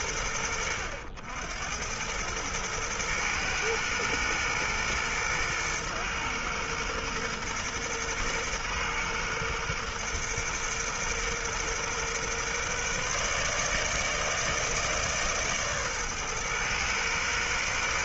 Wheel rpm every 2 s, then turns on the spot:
90, 120, 120, 120, 120, 120, 150, 150, 130.
none